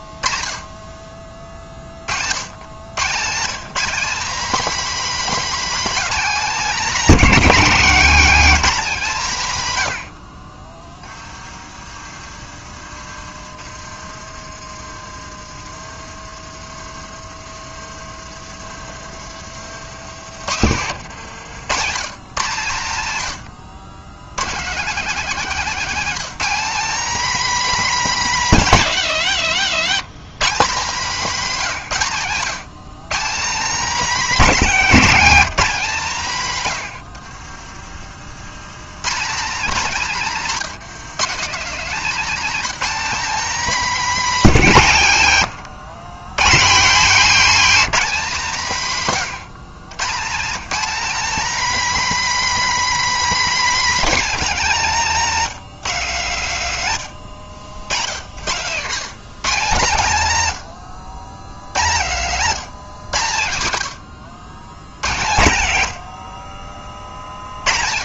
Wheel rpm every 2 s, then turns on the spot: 20, 120, 270, 240, 210, 20, 30, 40, 40, 50, 90, 110, 210, 260, 150, 190, 170, 240, 100, 140, 190, 240, 150, 200, 160, 210, 250, 200, 110, 130, 100, 140, 80, 70.
10-12 14-22